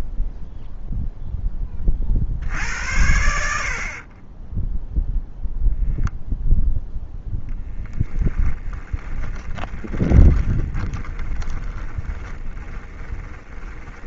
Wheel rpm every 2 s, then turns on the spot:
0, 80, 10, 0, 10, 20, 20.
4-6 8-14